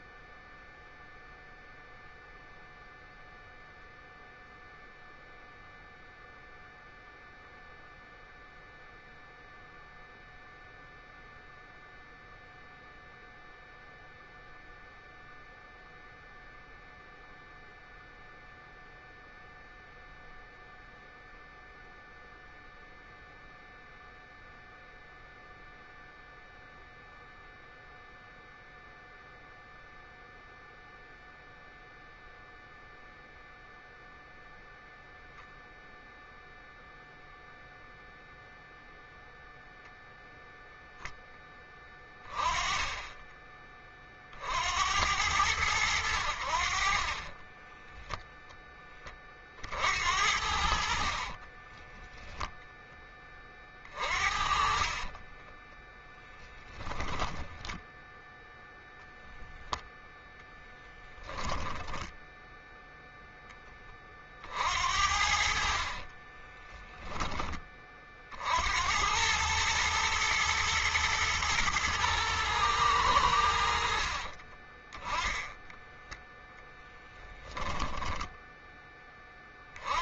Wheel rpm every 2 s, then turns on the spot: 0, 0, 0, 0, 0, 0, 0, 0, 0, 0, 0, 0, 0, 0, 0, 0, 0, 0, 0, 0, 0, 10, 70, 50, 20, 60, 10, 40, 10, 10, 10, 0, 60, 20, 80, 110, 100, 20, 0, 10.
50-52 54-58 66-68